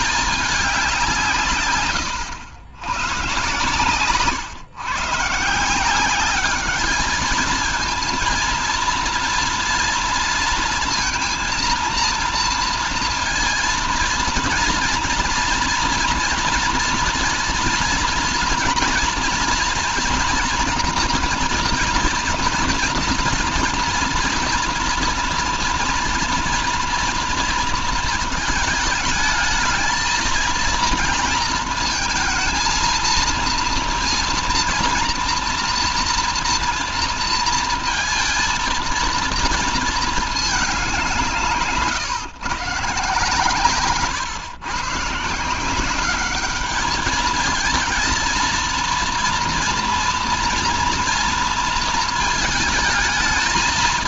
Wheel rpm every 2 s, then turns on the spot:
190, 120, 140, 210, 230, 230, 230, 230, 230, 240, 230, 230, 230, 230, 220, 220, 230, 240, 230, 230, 190, 130, 120, 210, 230, 230, 220.
none